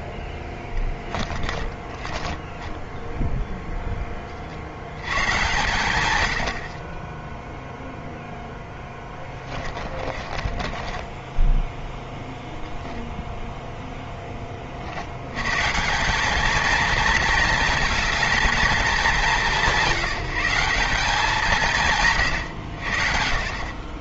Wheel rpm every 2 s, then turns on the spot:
10, 10, 120, 30, 20, 20, 0, 70, 220, 220, 200, 90.
0-4 6-12